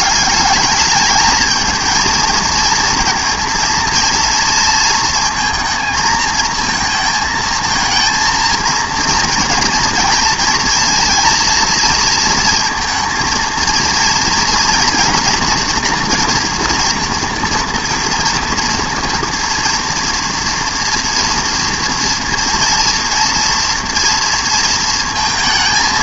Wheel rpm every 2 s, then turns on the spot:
200, 230, 230, 230, 230, 230, 230, 230, 240, 230, 230, 230, 230.
none